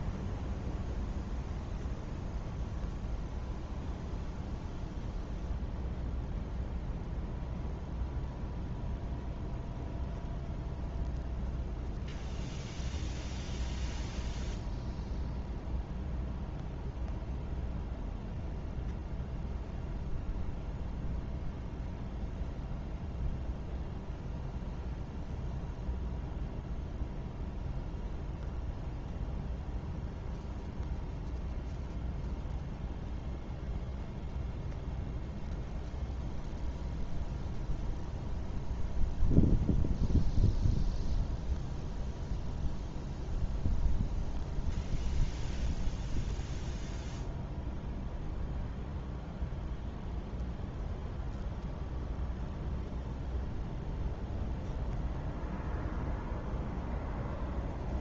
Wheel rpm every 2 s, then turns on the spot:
0, 0, 0, 0, 0, 0, 0, 0, 0, 0, 0, 0, 0, 0, 0, 0, 0, 0, 0, 0, 0, 0, 0, 0, 0, 0, 0, 0, 0.
none